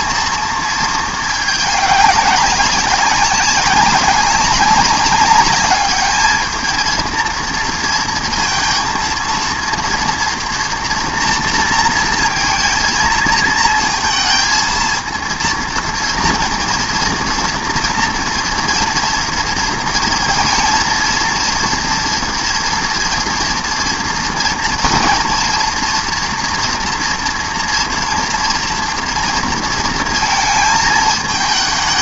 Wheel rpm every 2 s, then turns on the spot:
230, 190, 200, 220, 230, 230, 230, 220, 230, 230, 230, 240, 230, 230, 230, 230.
none